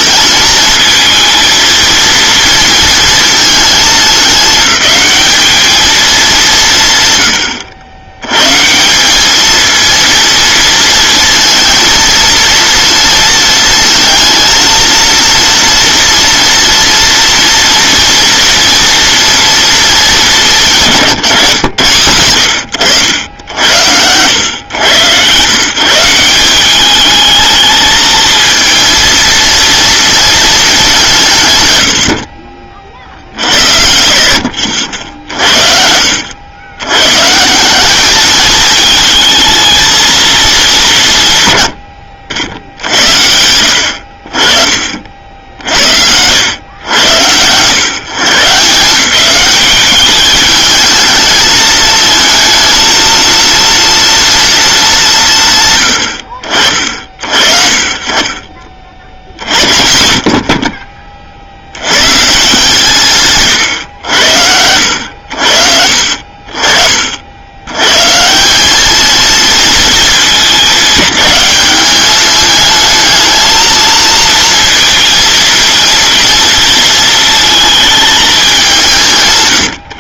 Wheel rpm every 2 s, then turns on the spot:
220, 230, 210, 150, 160, 230, 230, 230, 230, 230, 170, 90, 110, 190, 220, 210, 50, 80, 110, 220, 190, 70, 40, 100, 160, 210, 220, 220, 50, 50, 30, 150, 80, 40, 200, 210, 220, 230, 220, 180.
none